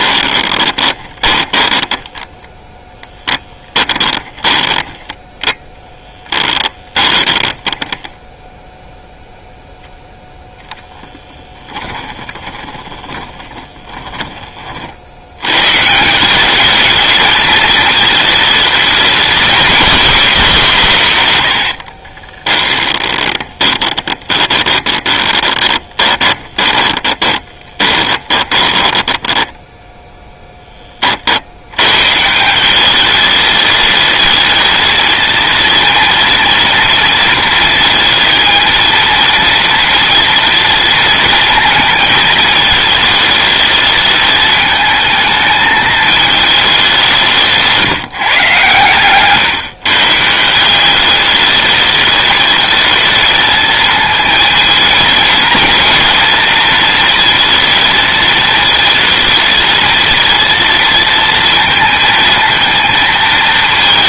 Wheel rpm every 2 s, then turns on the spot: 20, 10, 20, 20, 0, 10, 20, 50, 210, 210, 150, 20, 20, 20, 10, 30, 200, 220, 230, 230, 230, 220, 220, 190, 130, 190, 220, 220, 230, 220, 230, 230.
0-2 4-8 10-14 22-30